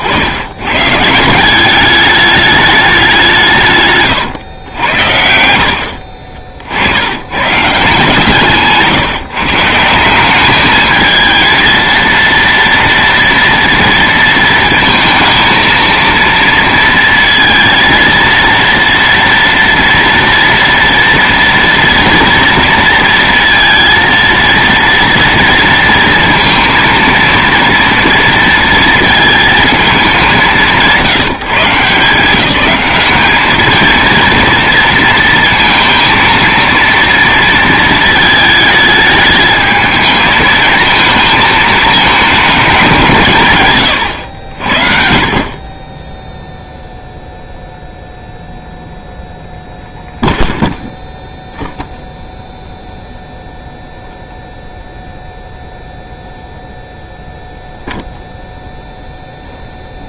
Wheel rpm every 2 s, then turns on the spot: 130, 210, 100, 80, 150, 210, 230, 230, 230, 230, 230, 230, 230, 230, 230, 180, 190, 230, 230, 220, 220, 200, 60, 0, 0, 0, 0, 0, 0, 0.
none